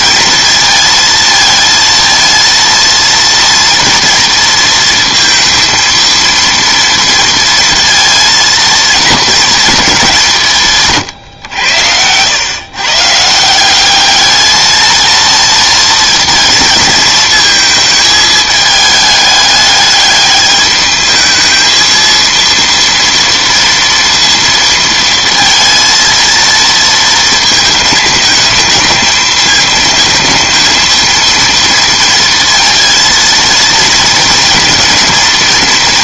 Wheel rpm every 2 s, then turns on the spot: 230, 230, 230, 230, 230, 160, 120, 220, 230, 220, 210, 230, 230, 230, 220, 230, 230, 220.
none